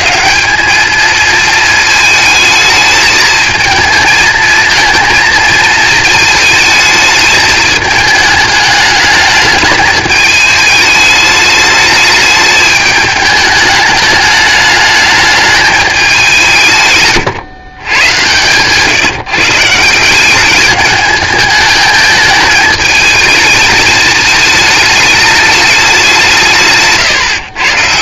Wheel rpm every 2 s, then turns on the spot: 200, 220, 230, 220, 210, 210, 210, 210, 140, 140, 210, 210, 220, 150.
none